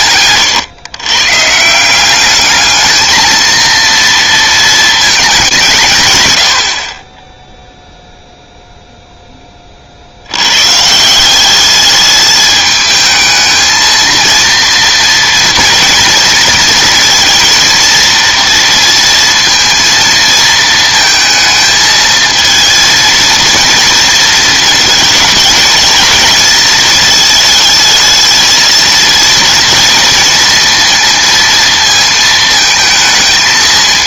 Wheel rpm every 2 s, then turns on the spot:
110, 210, 220, 50, 0, 140, 220, 230, 230, 230, 220, 230, 220, 220, 230, 230, 220.
none